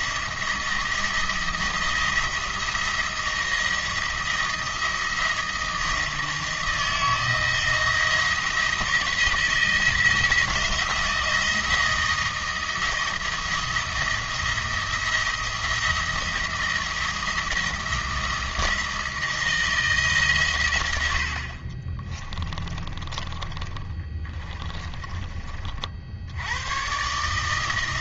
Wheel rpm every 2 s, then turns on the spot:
170, 170, 170, 170, 170, 170, 170, 170, 170, 170, 110, 20, 20, 110.
22-26